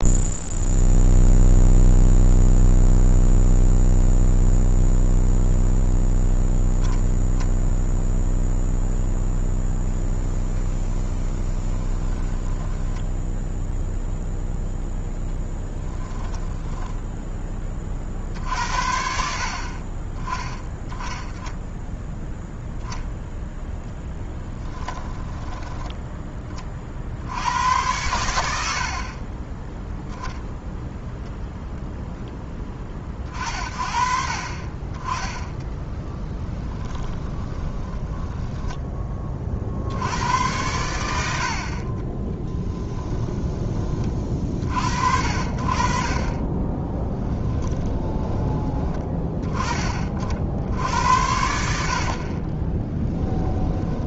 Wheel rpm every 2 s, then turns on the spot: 0, 0, 0, 0, 0, 10, 0, 0, 10, 60, 10, 0, 10, 60, 40, 0, 30, 20, 20, 20, 90, 20, 60, 10, 30, 80, 10.
10-12 24-26 36-38 42-44 46-48 52-54